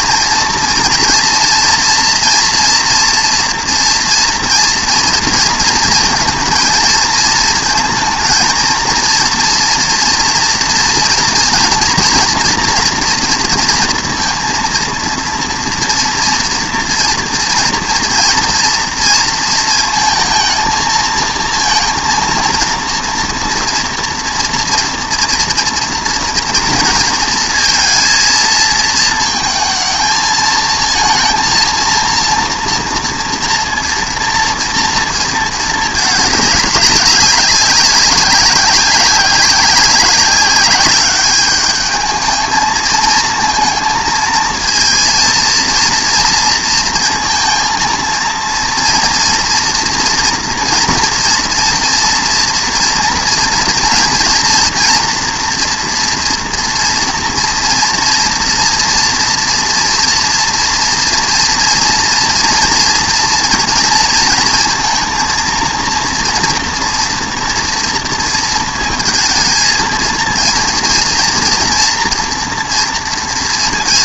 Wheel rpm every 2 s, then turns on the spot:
230, 230, 240, 220, 230, 230, 230, 230, 230, 230, 220, 230, 230, 230, 230, 220, 230, 230, 200, 190, 200, 220, 230, 230, 230, 230, 230, 230, 230, 230, 230, 230, 230, 230, 230, 230, 230.
none